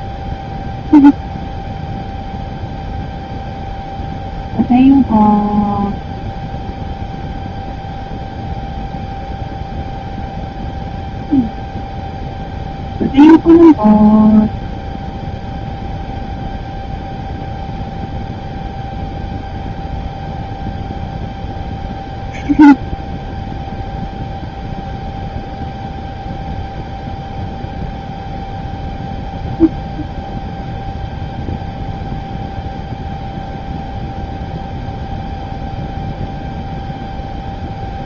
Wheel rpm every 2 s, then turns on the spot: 0, 0, 0, 0, 0, 0, 0, 0, 0, 0, 0, 0, 0, 0, 0, 0, 0, 0, 0.
none